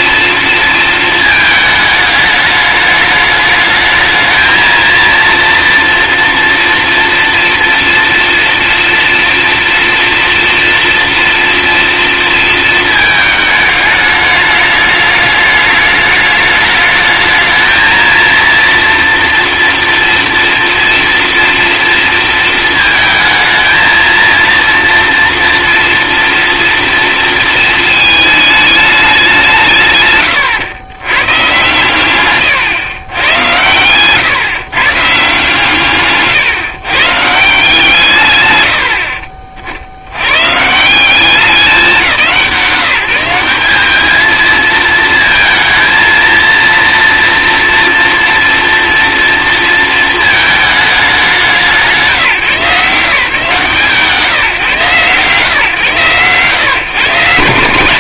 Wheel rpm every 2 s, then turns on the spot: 230, 210, 230, 230, 230, 230, 220, 210, 210, 230, 230, 230, 230, 230, 210, 110, 120, 140, 130, 90, 170, 160, 220, 230, 230, 210, 150, 150, 150.
none